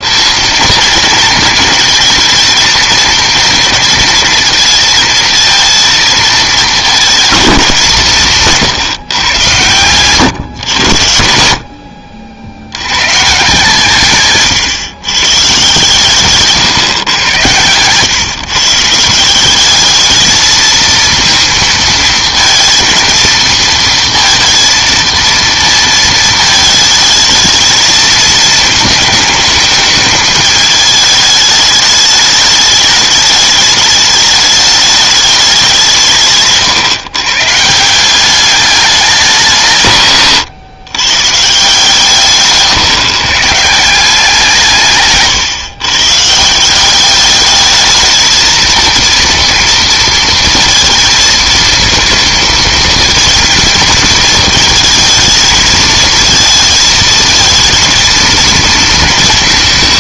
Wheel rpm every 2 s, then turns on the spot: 220, 220, 230, 220, 160, 110, 90, 140, 140, 140, 220, 230, 230, 220, 220, 220, 210, 210, 140, 200, 130, 140, 170, 160, 230, 230, 230, 230, 220, 230.
16-18